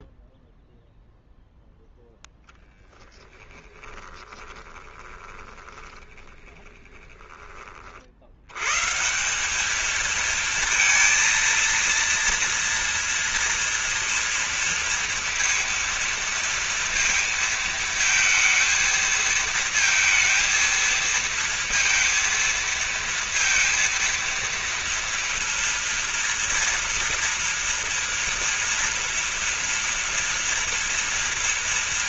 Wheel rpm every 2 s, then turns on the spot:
0, 0, 20, 20, 110, 230, 240, 230, 230, 220, 230, 230, 230, 230, 230, 240.
4-8